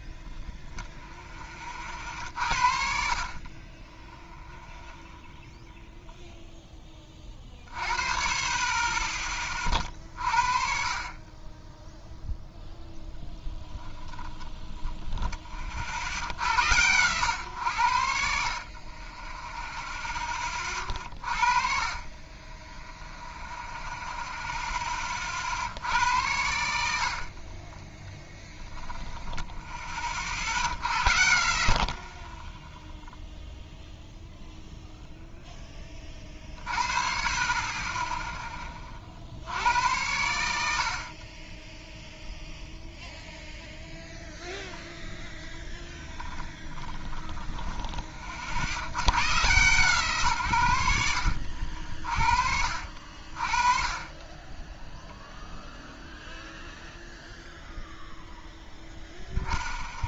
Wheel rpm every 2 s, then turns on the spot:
0, 60, 0, 10, 30, 50, 0, 20, 90, 50, 30, 10, 10, 90, 10, 70, 10, 0, 40, 20, 80, 0, 0, 10, 70, 110, 50, 10, 0, 0.
14-16 46-48